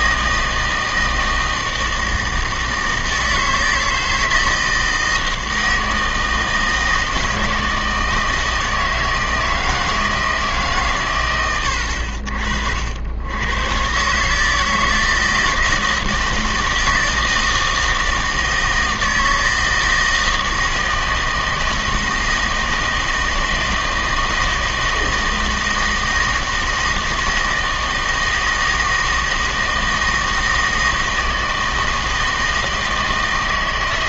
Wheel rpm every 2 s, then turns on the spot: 160, 160, 160, 160, 160, 150, 60, 160, 160, 160, 160, 160, 160, 160, 160, 160, 160.
none